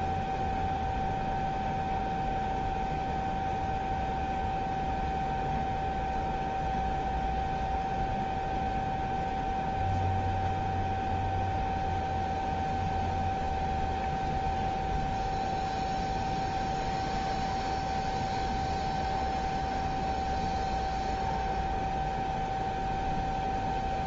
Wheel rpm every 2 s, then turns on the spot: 0, 0, 0, 0, 0, 0, 0, 0, 0, 0, 0, 0.
none